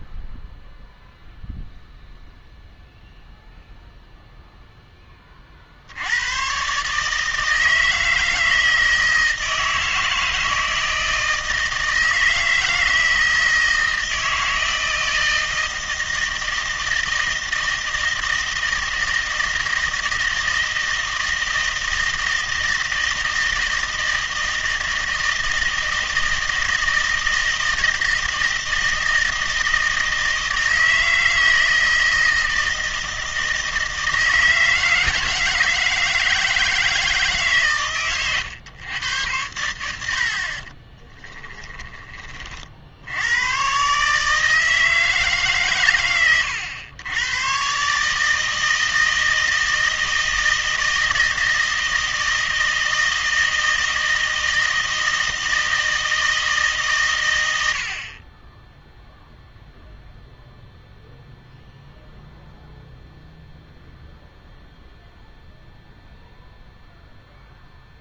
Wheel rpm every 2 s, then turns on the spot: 0, 0, 0, 130, 160, 160, 160, 160, 160, 160, 160, 160, 160, 160, 160, 160, 160, 160, 160, 120, 40, 50, 160, 100, 160, 160, 160, 160, 150, 10, 0, 0, 0, 0.
40-42